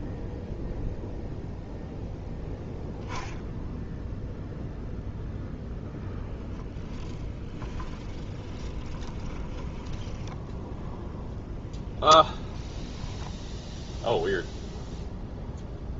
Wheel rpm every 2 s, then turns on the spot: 0, 0, 0, 20, 20, 0, 10, 0.
6-10 12-14